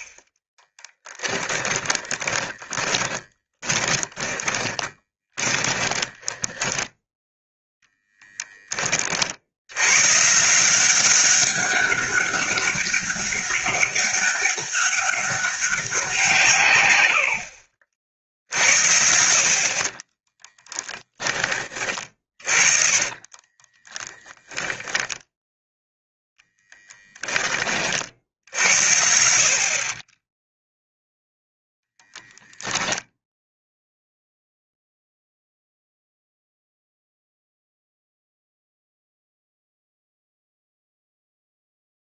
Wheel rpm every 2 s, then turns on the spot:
10, 20, 20, 10, 30, 180, 200, 200, 130, 70, 10, 20, 0, 20, 70, 0, 0, 0, 0, 0, 0.
0-8 22-24 26-28